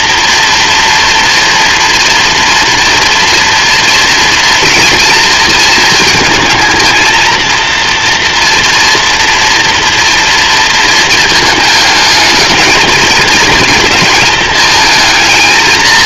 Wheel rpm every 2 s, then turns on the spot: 240, 230, 230, 230, 240, 230, 220, 220.
none